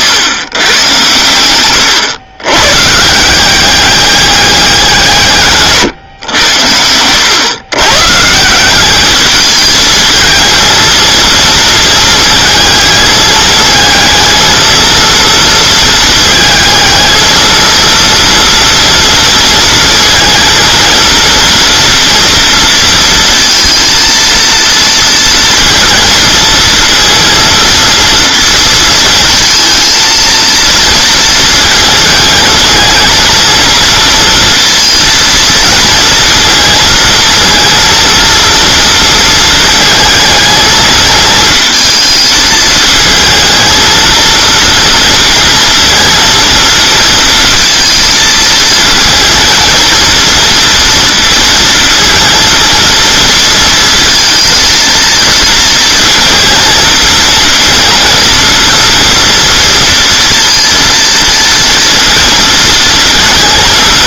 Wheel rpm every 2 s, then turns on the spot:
110, 140, 190, 90, 190, 230, 220, 230, 220, 230, 230, 230, 230, 230, 230, 230, 230, 230, 230, 230, 220, 220, 230, 230, 230, 230, 230, 230, 230, 230, 230, 230.
none